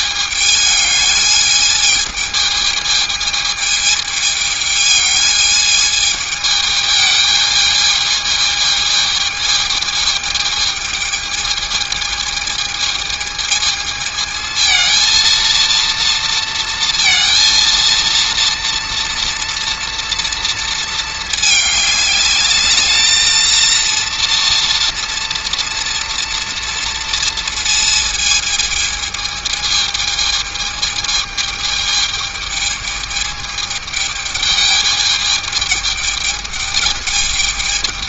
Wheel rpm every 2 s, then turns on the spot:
210, 220, 210, 220, 220, 220, 220, 230, 230, 230, 220, 210, 230, 230, 220, 220, 220, 210, 210.
none